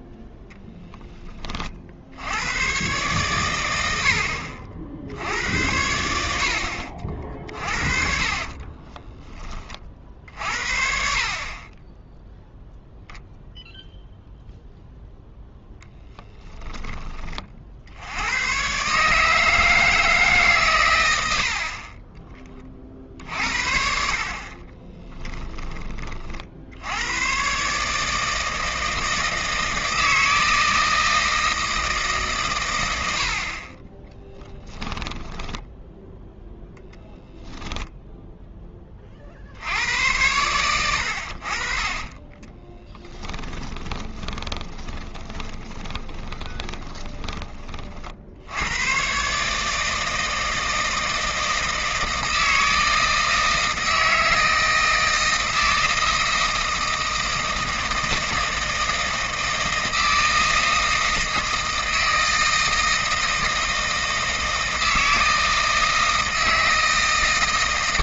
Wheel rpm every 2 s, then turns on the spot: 10, 130, 70, 70, 30, 50, 0, 0, 10, 140, 120, 40, 20, 80, 160, 160, 90, 10, 0, 20, 90, 10, 20, 30, 110, 160, 160, 160, 160, 160, 160, 160, 160, 160.
8-10 24-26 34-36 42-48